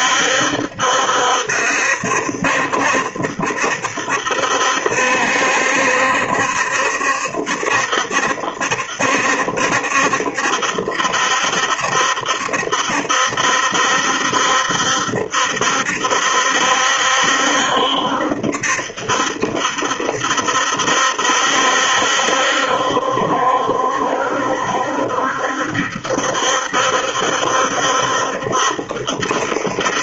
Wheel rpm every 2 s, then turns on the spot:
70, 70, 70, 70, 70, 70, 70, 70, 70, 70, 70, 70, 70, 70, 70.
none